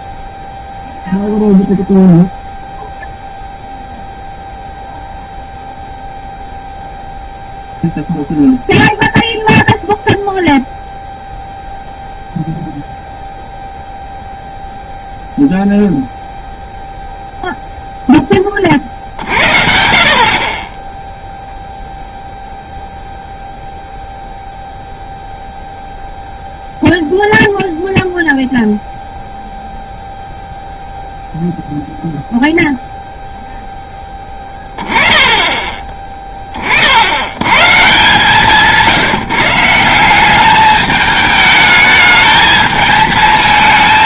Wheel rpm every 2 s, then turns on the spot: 0, 0, 0, 0, 0, 0, 0, 0, 0, 30, 30, 0, 0, 0, 0, 0, 0, 20, 30, 170, 210, 220.
none